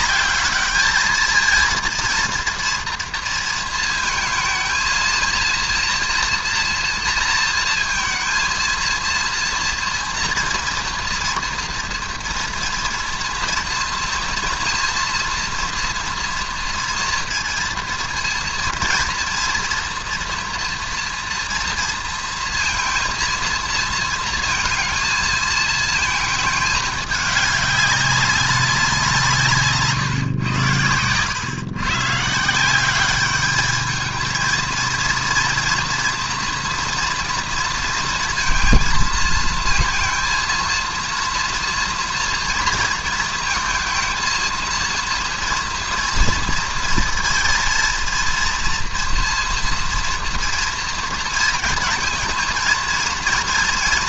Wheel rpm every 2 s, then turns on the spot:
210, 230, 230, 230, 230, 230, 230, 230, 230, 230, 230, 230, 230, 220, 190, 120, 170, 230, 230, 230, 230, 230, 230, 230, 230, 230, 230.
none